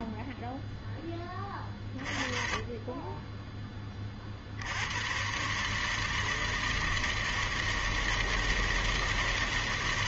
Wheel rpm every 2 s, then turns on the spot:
10, 20, 100, 160, 160.
none